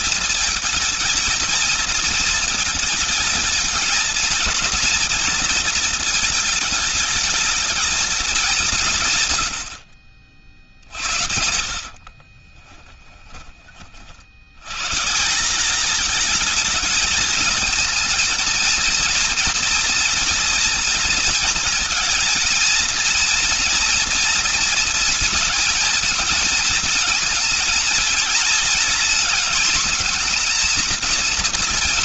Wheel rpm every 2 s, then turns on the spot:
220, 220, 220, 220, 190, 50, 30, 100, 220, 230, 230, 230, 230, 230, 220, 230.
12-14